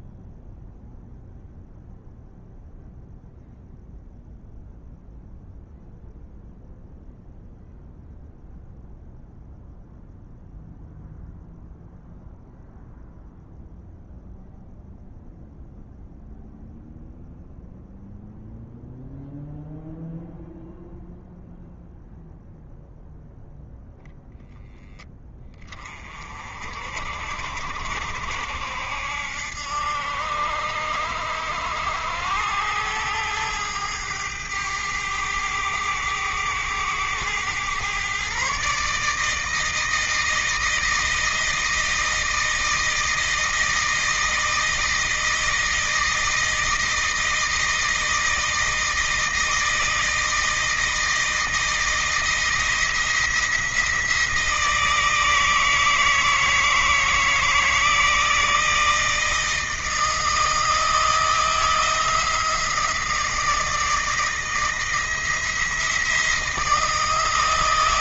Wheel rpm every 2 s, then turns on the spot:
0, 0, 0, 0, 0, 0, 0, 0, 0, 0, 0, 0, 0, 50, 70, 70, 100, 100, 100, 140, 160, 160, 160, 160, 160, 160, 170, 160, 160, 160, 160, 160, 160, 160.
none